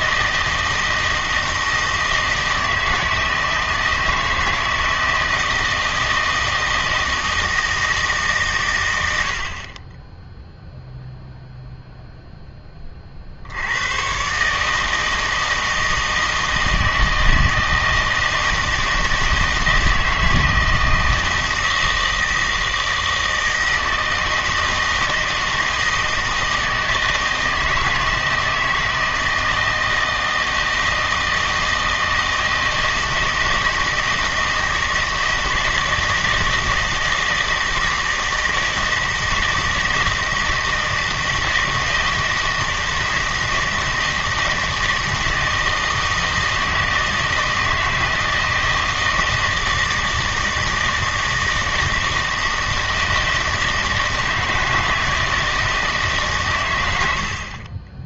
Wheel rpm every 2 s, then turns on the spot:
160, 160, 160, 160, 110, 0, 20, 150, 160, 160, 160, 160, 160, 160, 160, 160, 160, 160, 160, 170, 160, 160, 160, 160, 160, 160, 160, 160, 100.
none